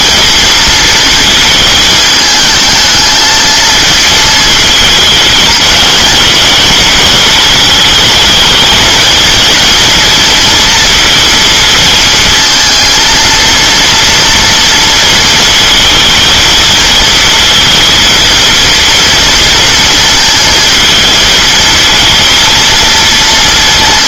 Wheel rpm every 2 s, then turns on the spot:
230, 220, 220, 220, 230, 230, 230, 230, 220, 230, 230, 230.
none